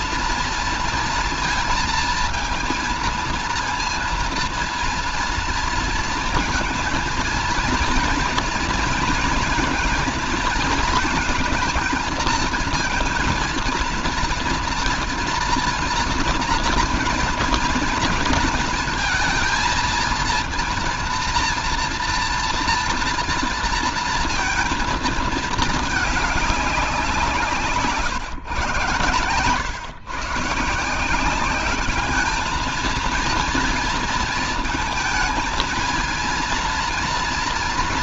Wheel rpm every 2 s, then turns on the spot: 230, 230, 230, 230, 230, 230, 220, 230, 230, 230, 230, 230, 230, 200, 130, 130, 210, 230, 230.
none